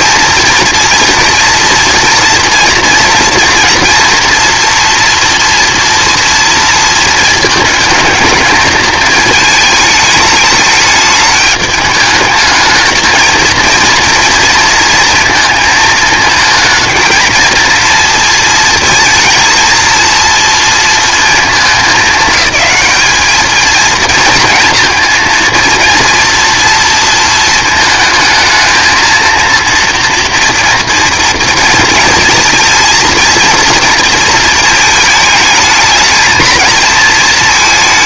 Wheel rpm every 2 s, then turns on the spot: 240, 230, 230, 220, 220, 210, 220, 230, 230, 230, 220, 210, 230, 230, 230, 230, 220, 220, 230.
none